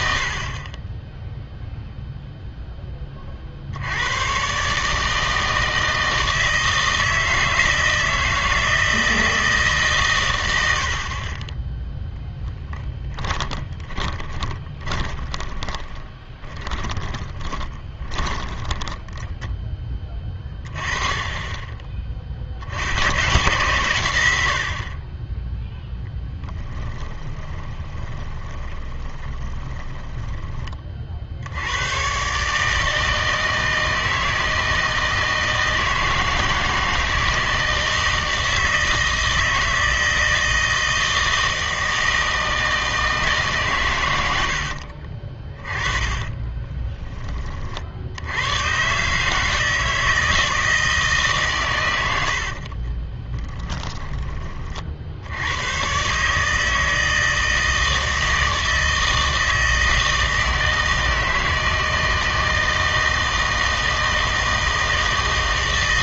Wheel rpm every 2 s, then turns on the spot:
40, 0, 130, 160, 160, 90, 10, 20, 20, 20, 20, 60, 60, 10, 20, 30, 150, 160, 160, 160, 160, 160, 70, 20, 110, 160, 60, 30, 150, 160, 160, 160, 160.
12-20 26-30 44-48 52-54